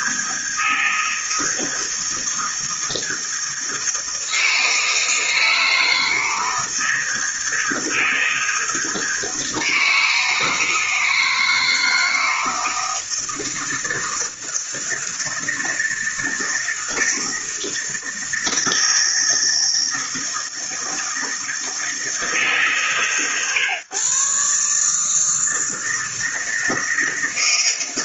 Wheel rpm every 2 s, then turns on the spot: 160, 160, 160, 160, 160, 160, 160, 160, 160, 160, 160, 160, 140, 160.
none